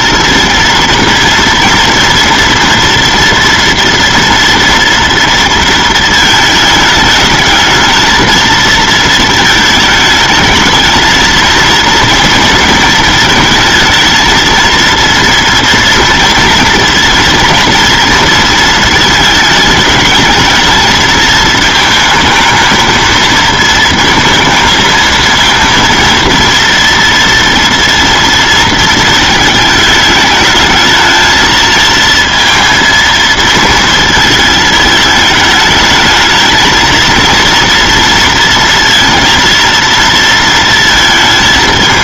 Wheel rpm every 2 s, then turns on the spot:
230, 230, 230, 220, 230, 220, 220, 230, 230, 220, 220, 220, 220, 230, 220, 220, 230, 220, 220, 230, 230.
none